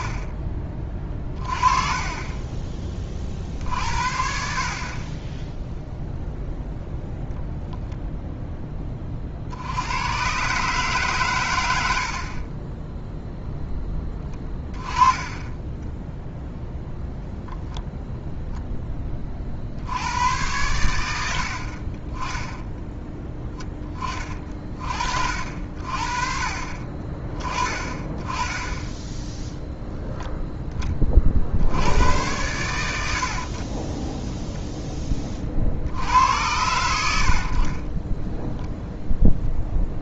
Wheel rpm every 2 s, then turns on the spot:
20, 30, 70, 0, 10, 140, 20, 20, 0, 10, 100, 10, 40, 40, 20, 10, 90, 10, 90, 0.
none